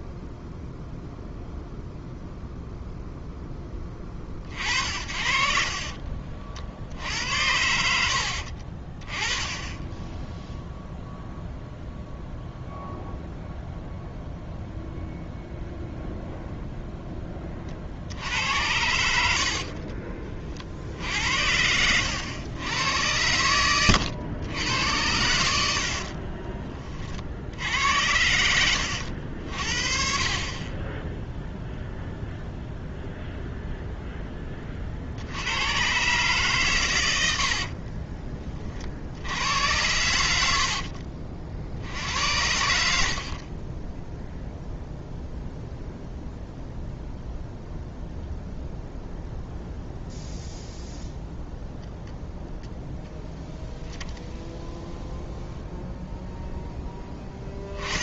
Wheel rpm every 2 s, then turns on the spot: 0, 0, 50, 50, 50, 0, 0, 0, 0, 90, 50, 100, 100, 30, 90, 30, 0, 30, 130, 40, 70, 70, 0, 0, 0, 0, 10, 0, 10.
28-30